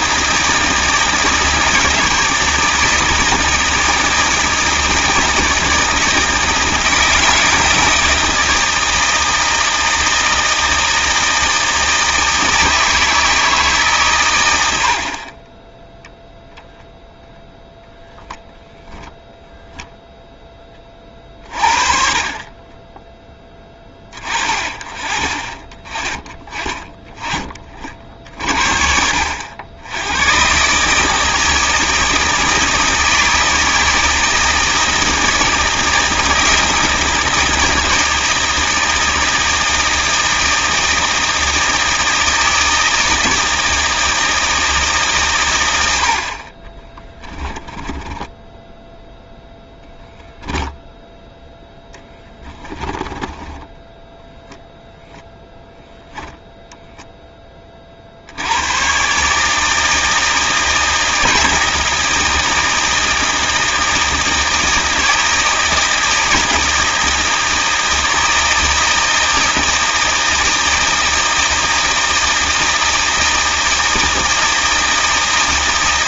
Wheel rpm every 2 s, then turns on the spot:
160, 160, 160, 160, 160, 160, 160, 70, 0, 0, 20, 30, 30, 20, 60, 130, 160, 160, 160, 160, 160, 160, 160, 40, 10, 0, 20, 0, 0, 100, 160, 160, 160, 160, 160, 160, 160, 160.
46-50 52-54